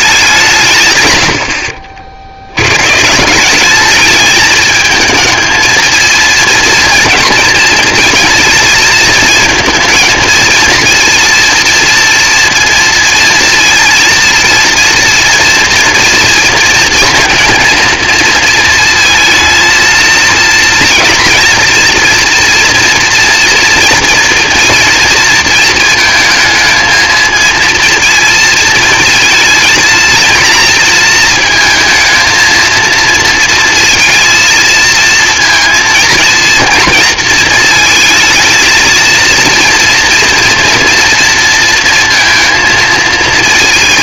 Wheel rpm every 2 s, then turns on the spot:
160, 100, 220, 230, 220, 230, 230, 230, 230, 230, 230, 230, 230, 220, 230, 230, 230, 230, 220, 230, 230, 230.
none